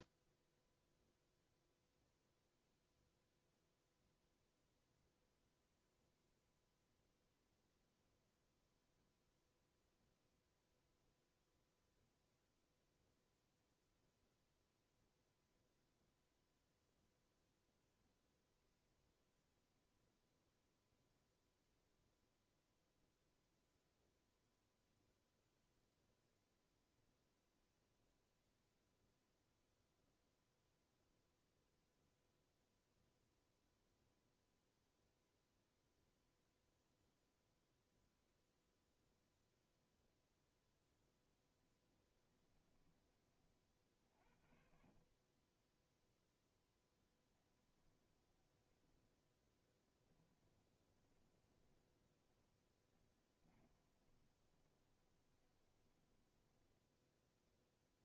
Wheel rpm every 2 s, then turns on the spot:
0, 0, 0, 0, 0, 0, 0, 0, 0, 0, 0, 0, 0, 0, 0, 0, 0, 0, 0, 0, 0, 20, 40, 10, 10, 20, 20, 20, 10.
46-56